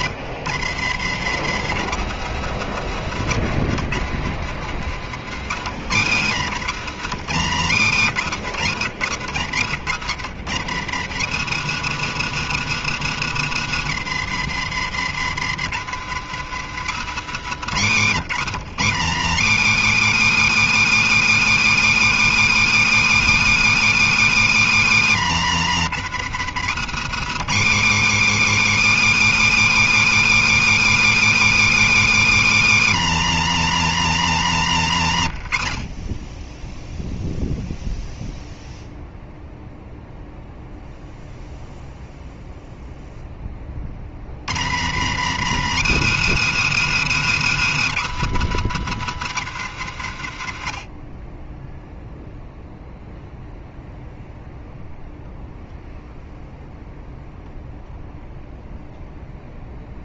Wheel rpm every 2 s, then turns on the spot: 130, 150, 130, 140, 120, 140, 170, 130, 140, 130, 160, 160, 140, 150, 160, 160, 140, 80, 0, 0, 0, 0, 120, 160, 160, 40, 0, 0, 0, 0.
none